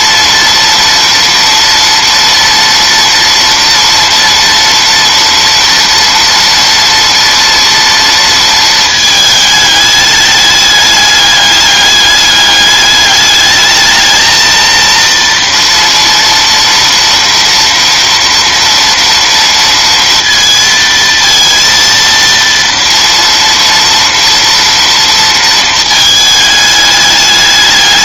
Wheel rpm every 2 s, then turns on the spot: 230, 230, 230, 230, 230, 210, 210, 230, 230, 230, 230, 230, 230, 210.
none